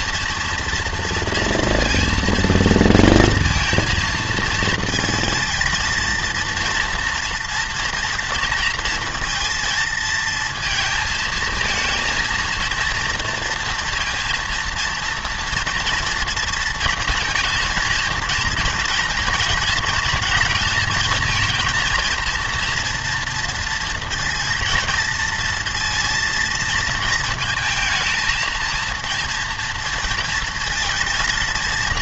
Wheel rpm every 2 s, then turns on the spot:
230, 230, 220, 230, 230, 230, 230, 230, 230, 240, 220, 230, 230, 230, 220, 230.
none